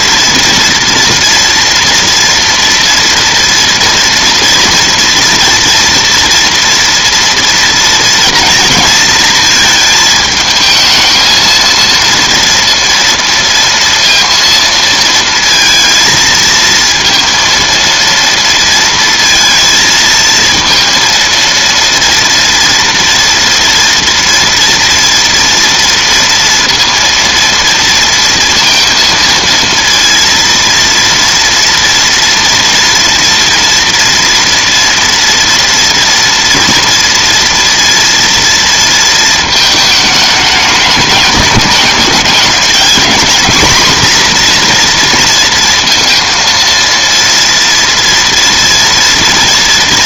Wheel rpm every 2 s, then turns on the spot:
230, 230, 230, 230, 230, 220, 230, 230, 230, 230, 230, 230, 240, 230, 230, 230, 230, 230, 230, 230, 210, 220, 240, 230, 230.
none